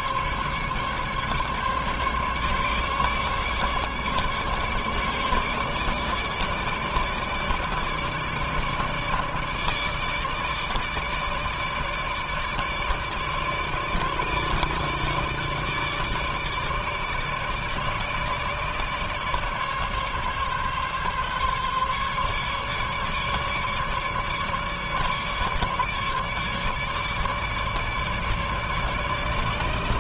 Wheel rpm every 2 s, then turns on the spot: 140, 140, 150, 150, 150, 150, 150, 150, 150, 150, 140, 150, 150, 150, 150.
none